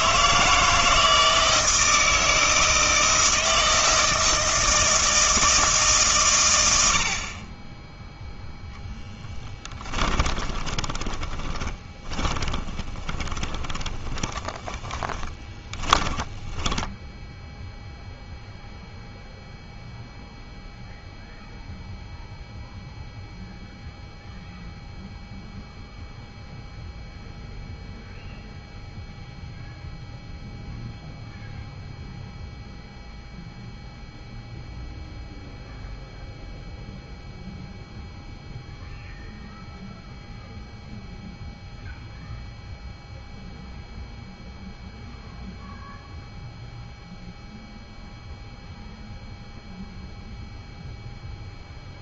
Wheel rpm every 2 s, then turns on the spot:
160, 160, 160, 90, 0, 20, 20, 20, 10, 0, 0, 0, 0, 0, 0, 0, 0, 0, 0, 0, 0, 0, 0, 0, 0, 0.
10-18